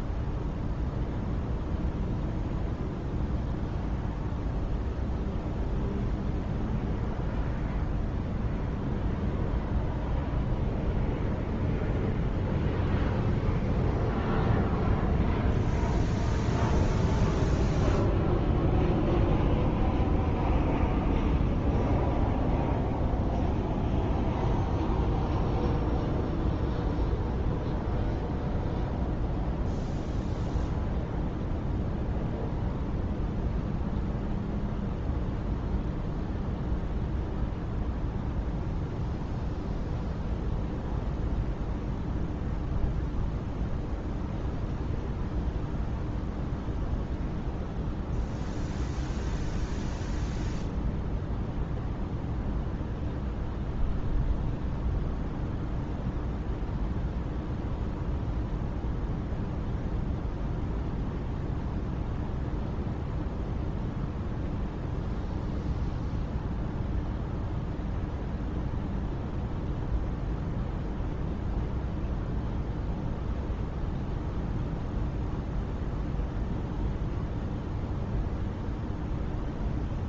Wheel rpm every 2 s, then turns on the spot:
0, 0, 0, 0, 0, 0, 0, 0, 0, 0, 0, 0, 0, 0, 0, 0, 0, 0, 0, 0, 0, 0, 0, 0, 0, 0, 0, 0, 0, 0, 0, 0, 0, 0, 0, 0, 0, 0, 0, 0.
none